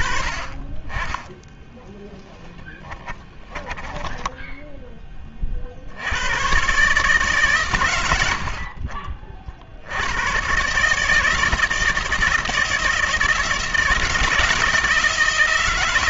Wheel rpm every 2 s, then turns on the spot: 20, 20, 30, 100, 50, 160, 160, 160.
2-4